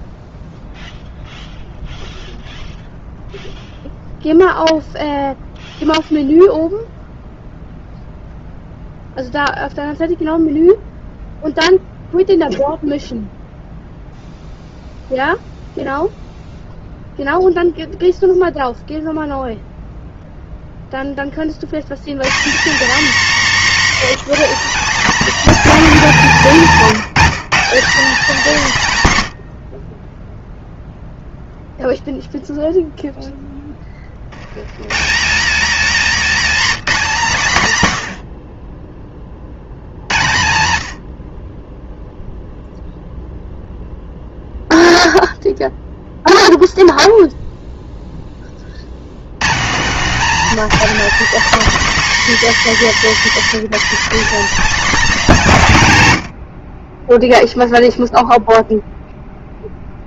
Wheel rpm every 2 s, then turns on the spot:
0, 0, 0, 0, 0, 0, 0, 0, 0, 0, 0, 220, 260, 210, 150, 0, 0, 140, 220, 30, 70, 0, 0, 0, 90, 250, 230, 260, 20, 0.
none